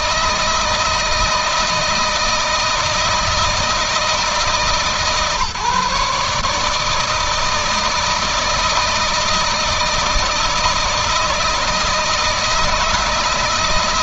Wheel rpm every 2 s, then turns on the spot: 160, 160, 150, 160, 160, 160, 160.
none